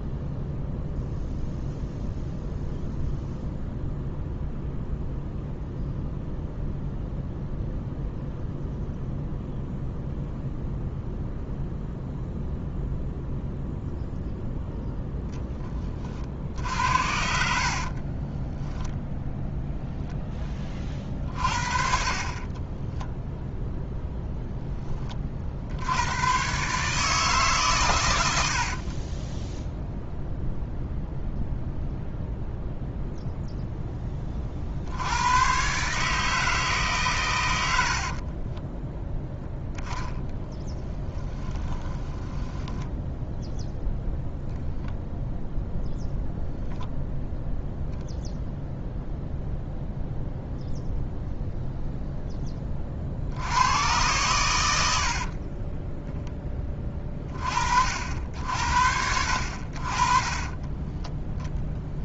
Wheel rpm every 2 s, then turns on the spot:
0, 0, 0, 0, 0, 0, 0, 0, 60, 10, 0, 20, 0, 130, 80, 0, 0, 50, 150, 20, 20, 10, 0, 0, 0, 0, 20, 100, 20, 70, 20.
18-20 22-24 38-44 60-62